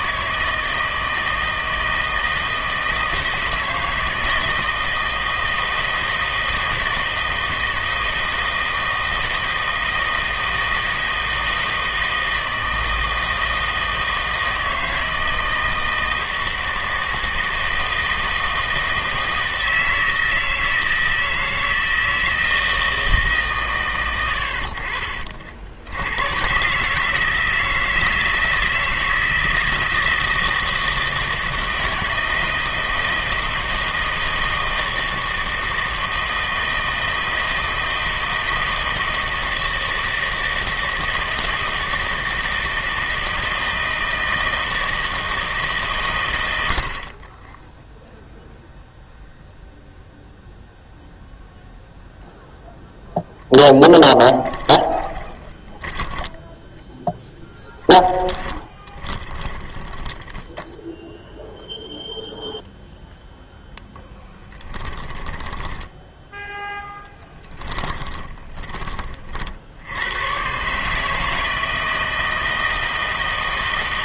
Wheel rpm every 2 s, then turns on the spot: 160, 160, 160, 160, 160, 160, 160, 160, 160, 160, 160, 160, 60, 130, 160, 160, 160, 160, 160, 160, 160, 160, 160, 70, 0, 0, 0, 10, 10, 20, 10, 0, 20, 0, 20, 140, 160.
54-62 64-66